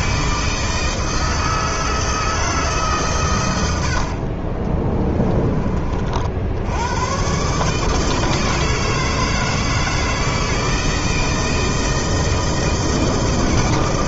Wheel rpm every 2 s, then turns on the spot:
160, 150, 30, 80, 160, 160, 160.
4-6